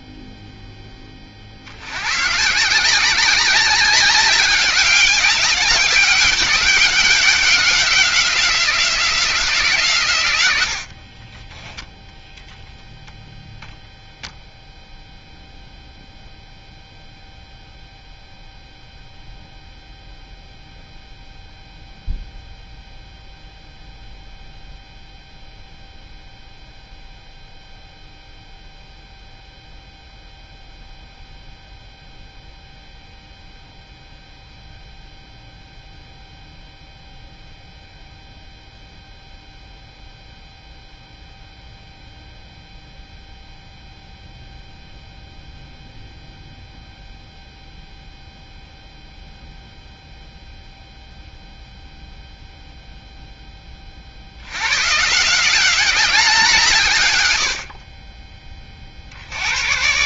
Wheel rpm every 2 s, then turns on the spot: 10, 160, 200, 190, 180, 90, 0, 0, 0, 0, 0, 0, 0, 0, 0, 0, 0, 0, 0, 0, 0, 0, 0, 0, 0, 0, 0, 100, 170, 30.
10-12